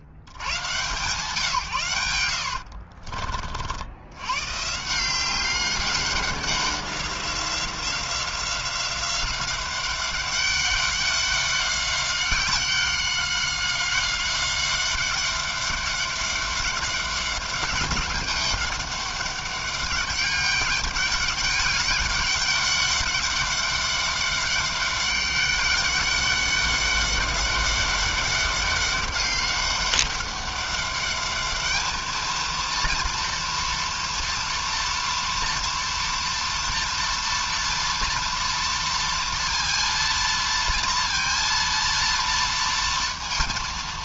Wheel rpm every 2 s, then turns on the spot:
120, 70, 120, 190, 180, 200, 190, 190, 200, 200, 200, 200, 200, 200, 200, 200, 230, 230, 230, 230, 230, 230.
2-4